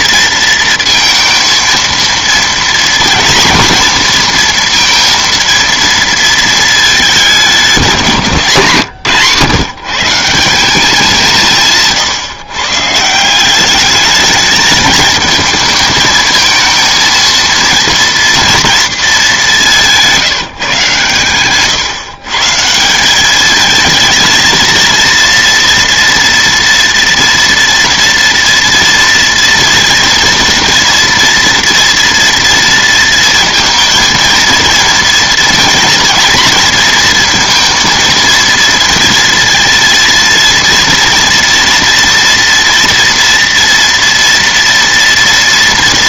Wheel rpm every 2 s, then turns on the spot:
230, 230, 230, 220, 150, 190, 140, 220, 220, 230, 160, 150, 230, 230, 230, 230, 230, 230, 230, 230, 230, 230, 230.
none